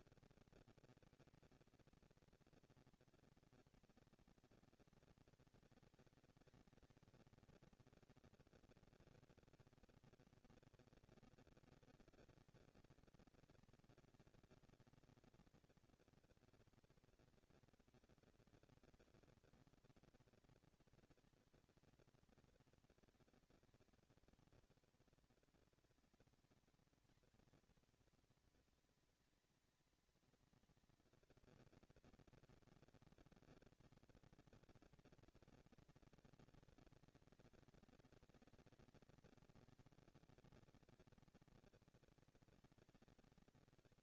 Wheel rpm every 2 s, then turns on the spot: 230, 230, 230, 220, 230, 220, 230, 240, 230, 230, 220, 220, 210, 220, 220, 220, 230, 230, 230, 220, 230, 220.
none